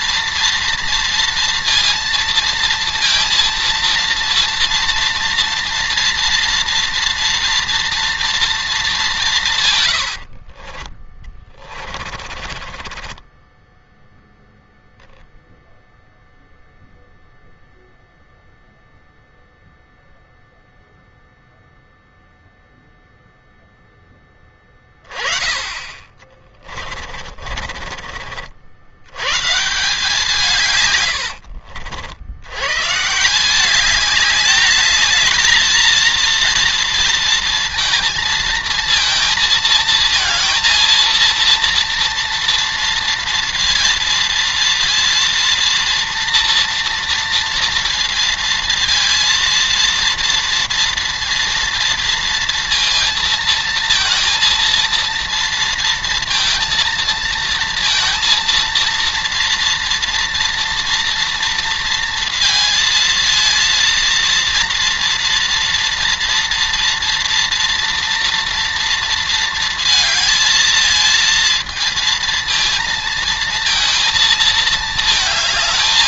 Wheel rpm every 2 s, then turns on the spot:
230, 230, 230, 240, 220, 40, 20, 0, 0, 0, 0, 0, 20, 40, 80, 140, 110, 210, 230, 230, 230, 230, 230, 230, 230, 230, 230, 230, 230, 230, 240, 230, 230, 230, 230, 220, 230, 220.
10-14 26-28